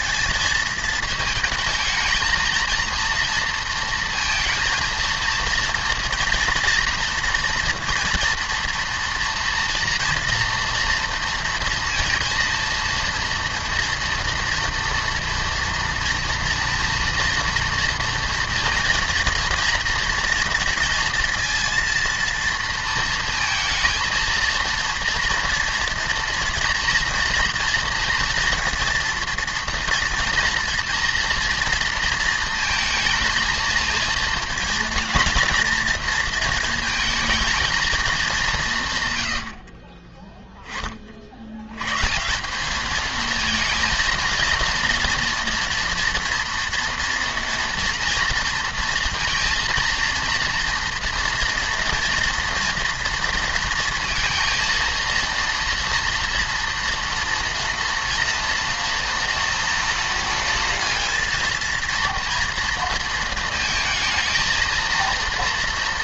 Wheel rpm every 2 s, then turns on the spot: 220, 230, 230, 230, 230, 230, 230, 230, 230, 230, 230, 230, 230, 230, 230, 230, 220, 220, 230, 180, 20, 200, 230, 230, 230, 230, 230, 230, 230, 230, 230, 230, 230.
none